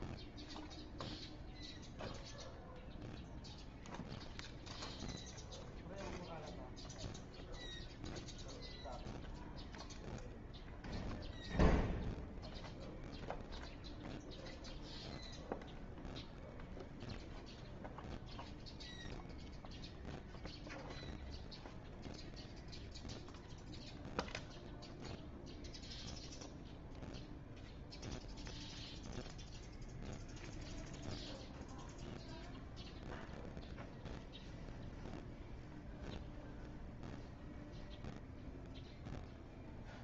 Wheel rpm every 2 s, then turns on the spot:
0, 0, 0, 0, 0, 0, 0, 0, 0, 0, 0, 0, 0, 0, 0, 0, 0, 0, 0, 0.
none